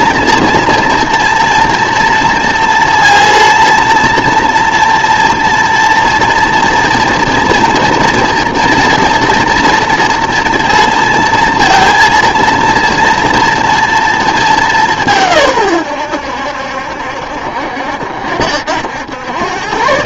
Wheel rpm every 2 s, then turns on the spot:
230, 230, 230, 230, 230, 230, 230, 200, 70, 80.
none